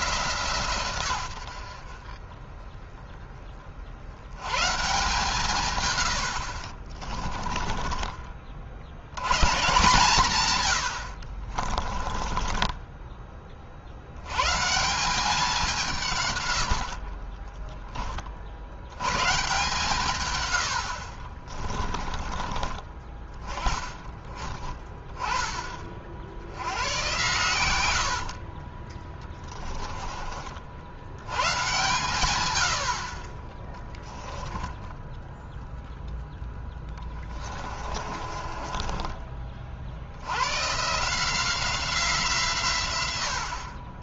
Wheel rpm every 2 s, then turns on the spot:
140, 20, 130, 60, 50, 120, 20, 130, 90, 60, 100, 30, 20, 90, 40, 50, 80, 10, 10, 30, 110, 130.
6-8 12-14 16-18 28-30 34-40